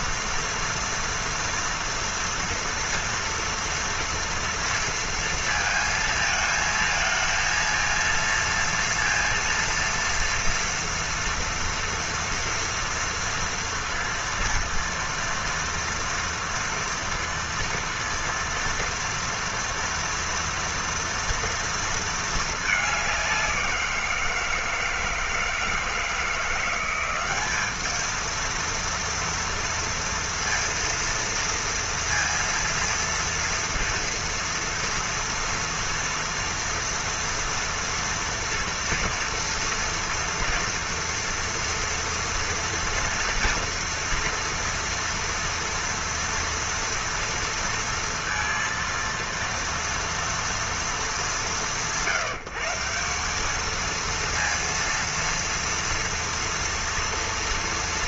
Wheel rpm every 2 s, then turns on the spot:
230, 230, 230, 220, 230, 230, 230, 230, 230, 230, 230, 210, 160, 170, 230, 230, 230, 230, 230, 230, 230, 230, 230, 230, 230, 230, 170, 230, 230.
none